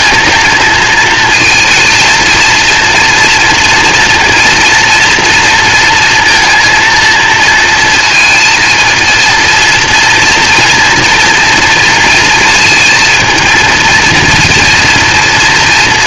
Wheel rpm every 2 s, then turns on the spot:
230, 230, 230, 230, 230, 230, 230, 230.
none